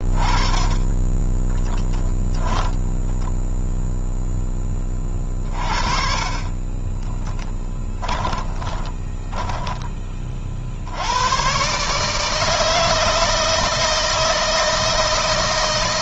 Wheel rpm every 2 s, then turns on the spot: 20, 10, 30, 30, 10, 80, 160, 160.
0-2 6-10